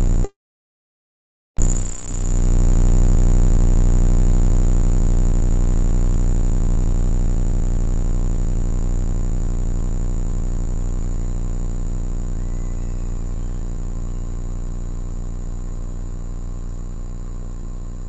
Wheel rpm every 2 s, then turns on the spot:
0, 0, 0, 0, 0, 0, 0, 0, 0.
none